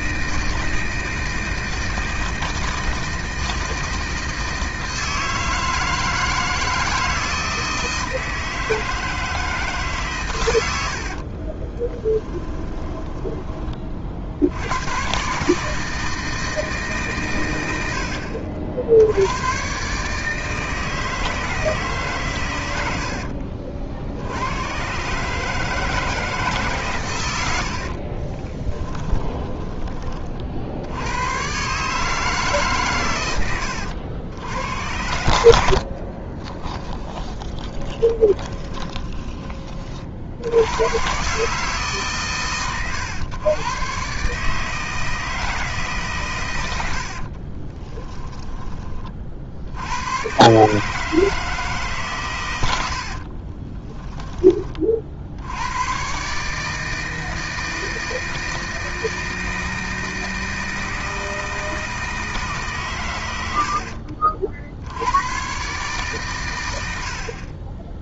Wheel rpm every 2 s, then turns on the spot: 160, 160, 160, 160, 160, 70, 20, 120, 140, 90, 160, 70, 130, 120, 20, 90, 110, 80, 10, 20, 120, 120, 160, 70, 60, 160, 70, 50, 160, 160, 160, 120, 80, 60.
10-14 28-30 36-40 46-48 52-54